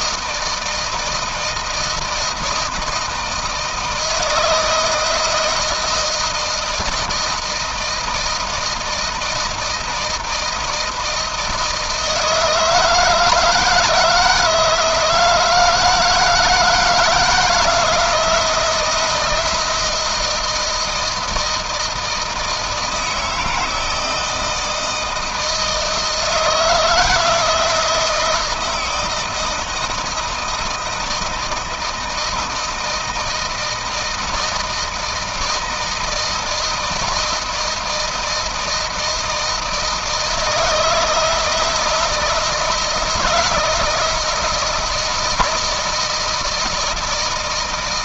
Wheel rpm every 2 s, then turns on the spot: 160, 160, 160, 160, 160, 160, 160, 160, 160, 160, 160, 160, 160, 160, 170, 160, 160, 160, 160, 160, 160, 170, 160, 160.
none